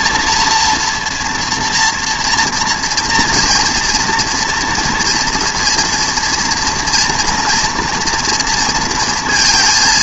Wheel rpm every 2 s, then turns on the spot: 230, 230, 240, 230, 230.
none